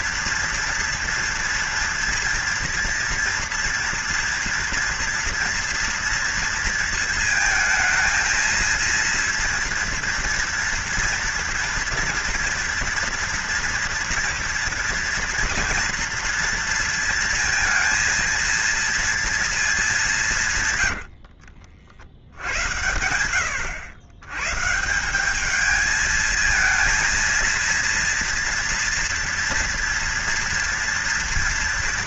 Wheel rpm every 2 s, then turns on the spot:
230, 230, 230, 230, 230, 230, 240, 230, 230, 230, 110, 90, 160, 230, 230, 230.
20-22